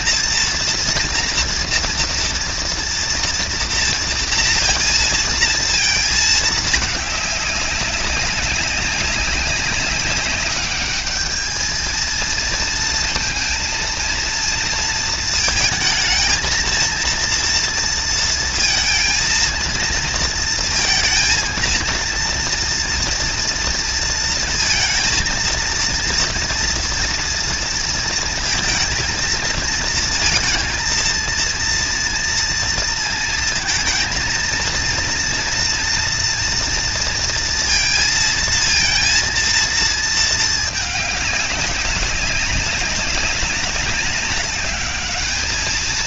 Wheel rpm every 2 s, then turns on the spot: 230, 230, 230, 210, 200, 210, 220, 230, 230, 230, 230, 230, 230, 230, 230, 230, 230, 230, 230, 230, 210, 200, 200.
none